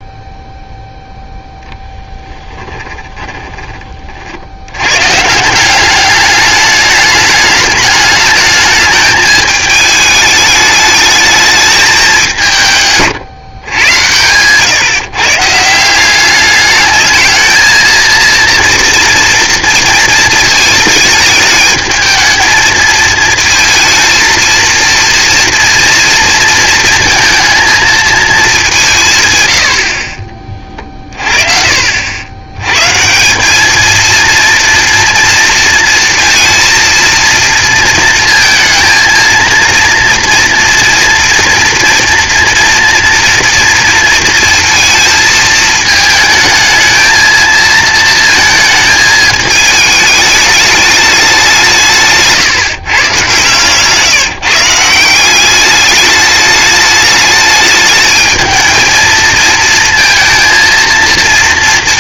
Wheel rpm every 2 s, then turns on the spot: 0, 10, 70, 200, 210, 220, 170, 120, 210, 240, 220, 220, 230, 230, 200, 30, 120, 230, 230, 230, 230, 230, 230, 220, 220, 210, 160, 160, 210, 220, 230.
2-4